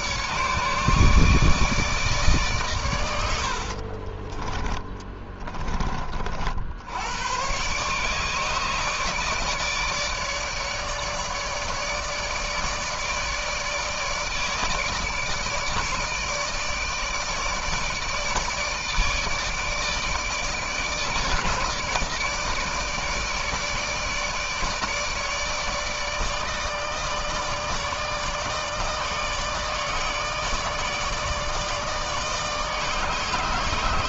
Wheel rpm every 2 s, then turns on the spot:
150, 130, 20, 70, 150, 150, 160, 150, 160, 150, 160, 160, 150, 150, 160, 150, 150.
4-6